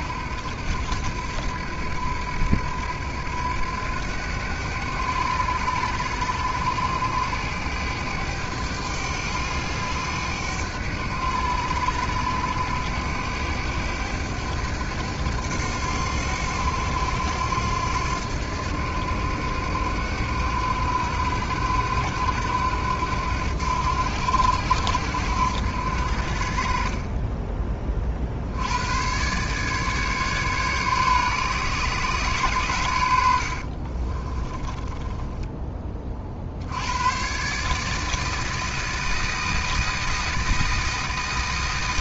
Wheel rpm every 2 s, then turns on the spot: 80, 80, 100, 100, 100, 100, 100, 100, 90, 90, 90, 90, 80, 50, 70, 140, 110, 20, 50, 160, 160.
34-36